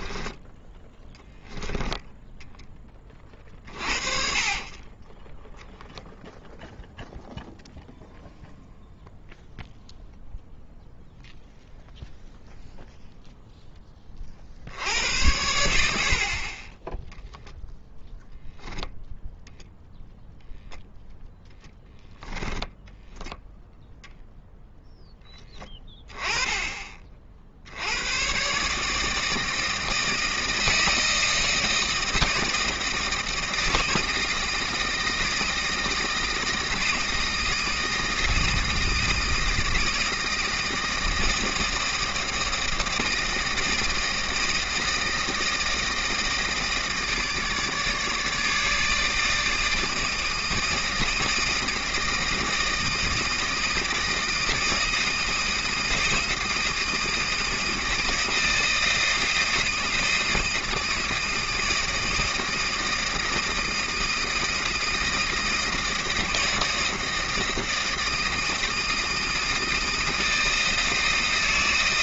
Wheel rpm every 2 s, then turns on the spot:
10, 10, 30, 0, 0, 0, 0, 60, 20, 0, 0, 10, 0, 20, 150, 160, 160, 160, 160, 160, 160, 160, 160, 160, 150, 160, 160, 160, 160, 160, 160, 160, 160, 160, 160, 160.
0-2